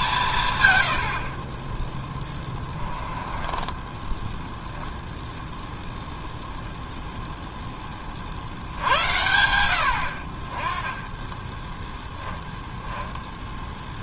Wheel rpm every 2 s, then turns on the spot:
130, 20, 0, 0, 70, 30, 10.
2-4 12-14